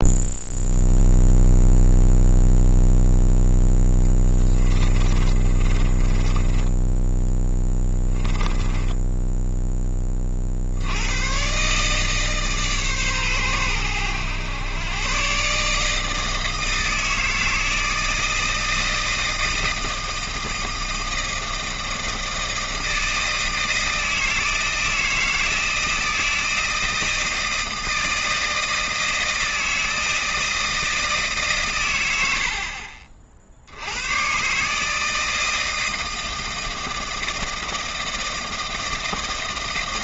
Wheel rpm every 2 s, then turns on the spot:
0, 0, 30, 10, 10, 60, 140, 110, 160, 160, 160, 160, 160, 160, 160, 160, 60, 140, 160, 160.
4-10